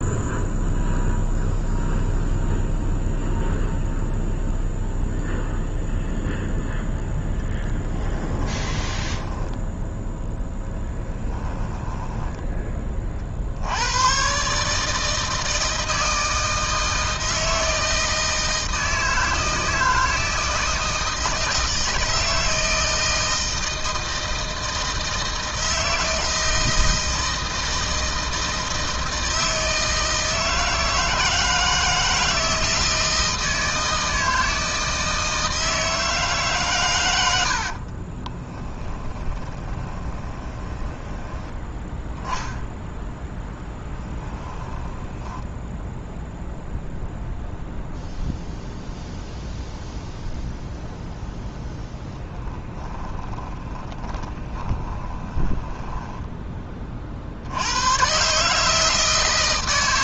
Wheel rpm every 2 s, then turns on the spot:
0, 0, 0, 0, 10, 10, 30, 160, 160, 160, 160, 160, 160, 160, 160, 160, 160, 160, 110, 10, 20, 0, 10, 0, 0, 0, 20, 20, 40, 160.
8-12 38-42 44-46 52-56